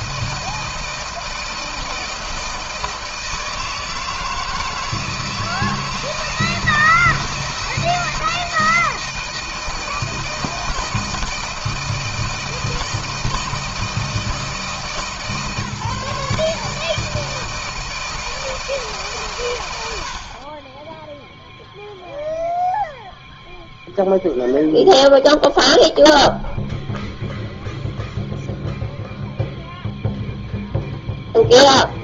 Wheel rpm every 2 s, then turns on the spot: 160, 160, 160, 170, 160, 160, 160, 160, 150, 160, 20, 0, 0, 0, 0, 0.
none